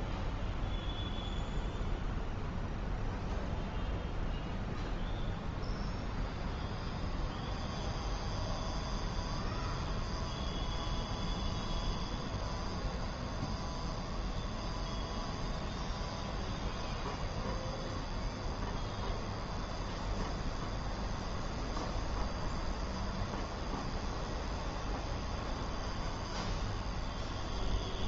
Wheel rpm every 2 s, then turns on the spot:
0, 0, 0, 0, 0, 0, 0, 0, 0, 0, 0, 0, 0, 0.
none